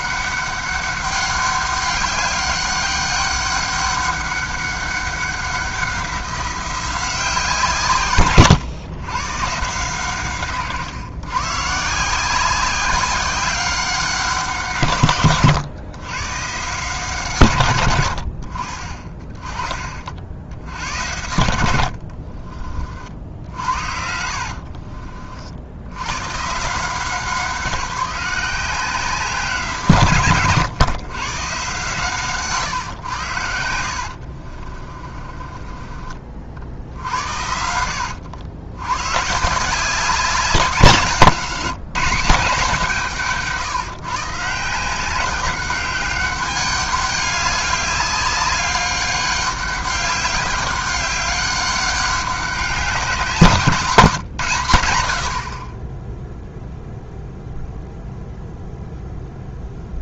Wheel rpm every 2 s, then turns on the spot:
200, 200, 200, 180, 120, 130, 180, 140, 140, 40, 70, 40, 50, 150, 180, 120, 130, 40, 50, 100, 180, 180, 170, 200, 200, 200, 200, 120, 0, 0.
24-26 32-36